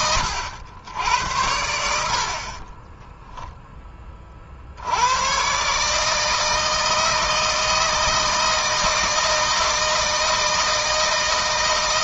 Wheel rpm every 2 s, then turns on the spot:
80, 30, 60, 160, 160, 160.
2-4